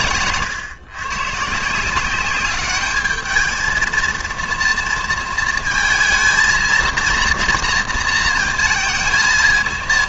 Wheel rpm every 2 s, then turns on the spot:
130, 200, 230, 230, 230.
none